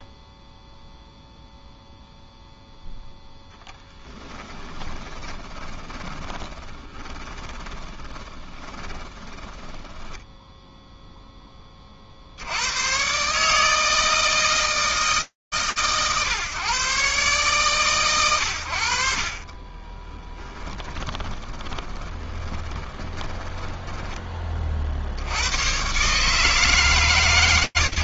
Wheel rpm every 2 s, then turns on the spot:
0, 0, 0, 10, 20, 20, 0, 120, 130, 140, 30, 20, 10, 80.
6-12 20-26